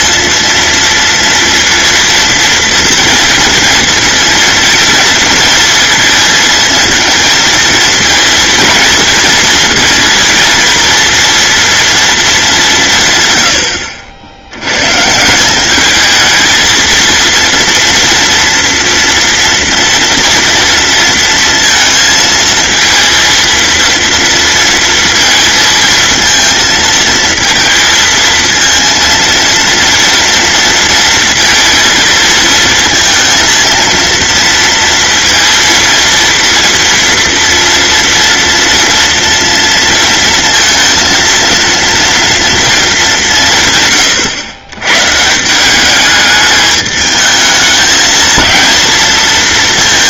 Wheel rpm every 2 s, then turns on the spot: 230, 230, 230, 220, 230, 230, 170, 110, 230, 230, 230, 230, 230, 230, 230, 230, 230, 230, 230, 230, 230, 210, 120, 210, 220.
none